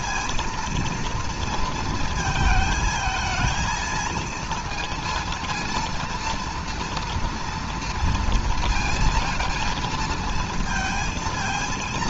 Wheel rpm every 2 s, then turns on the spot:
230, 220, 230, 230, 230, 220.
none